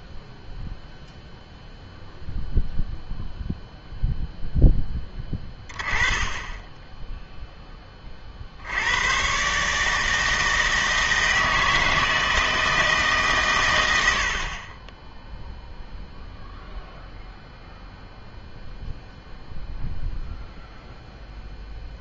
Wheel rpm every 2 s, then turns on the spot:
0, 0, 0, 20, 70, 160, 160, 40, 0, 0, 0.
none